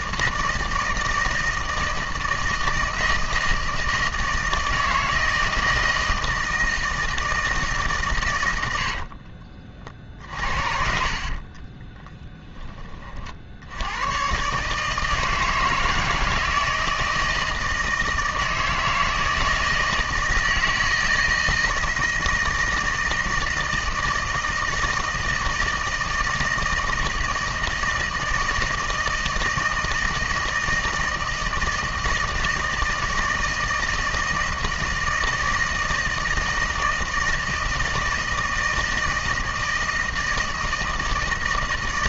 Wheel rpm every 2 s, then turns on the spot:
160, 160, 160, 160, 100, 50, 20, 140, 160, 160, 160, 160, 160, 160, 160, 160, 160, 160, 160, 160, 160.
10-12